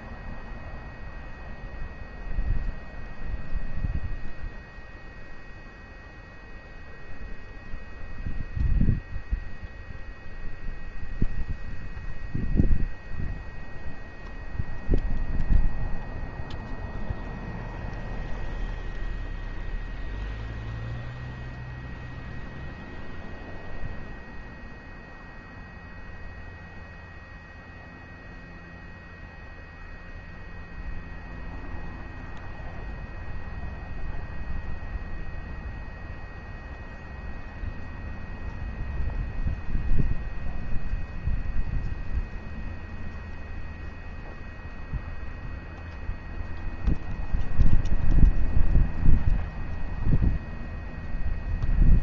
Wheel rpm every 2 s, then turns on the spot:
0, 0, 0, 0, 0, 0, 0, 0, 0, 0, 0, 0, 0, 0, 0, 0, 0, 0, 0, 0, 0, 0, 0, 0, 0, 0.
none